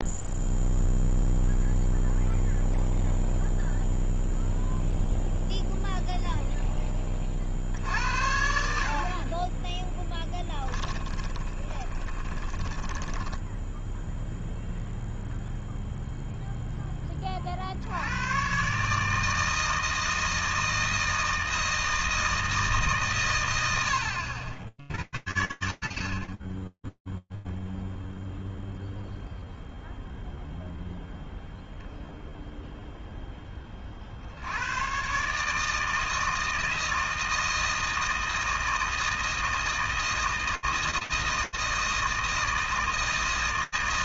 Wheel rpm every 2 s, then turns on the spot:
0, 0, 0, 10, 60, 10, 10, 0, 10, 140, 160, 150, 70, 10, 0, 0, 10, 140, 160, 160, 160, 160.
10-14